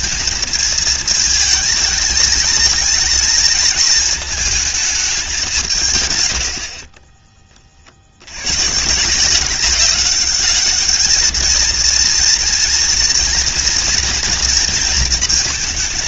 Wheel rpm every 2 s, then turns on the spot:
220, 220, 200, 30, 150, 210, 230, 230.
6-8